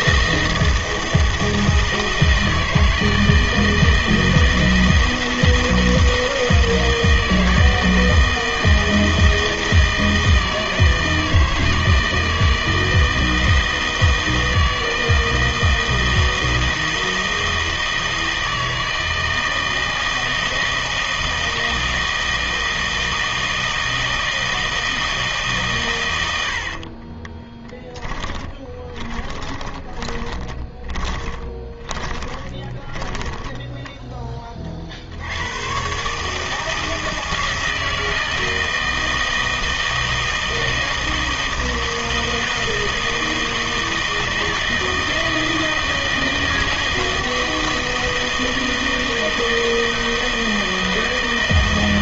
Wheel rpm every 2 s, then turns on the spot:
160, 160, 160, 160, 160, 160, 160, 160, 160, 160, 160, 160, 160, 60, 20, 20, 20, 40, 160, 160, 160, 160, 160, 160, 160, 160.
26-34